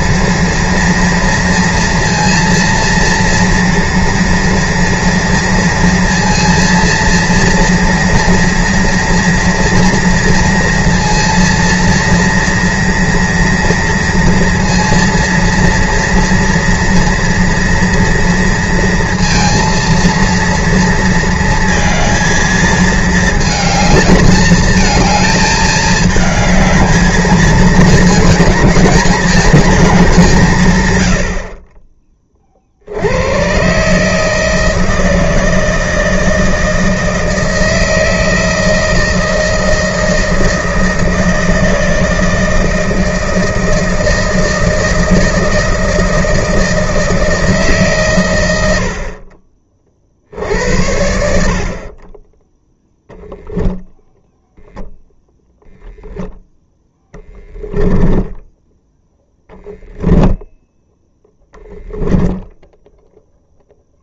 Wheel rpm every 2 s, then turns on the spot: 230, 230, 230, 230, 230, 230, 230, 230, 230, 230, 230, 220, 220, 220, 220, 110, 70, 160, 160, 160, 160, 160, 160, 160, 60, 70, 0, 0, 20, 0, 0, 0.
none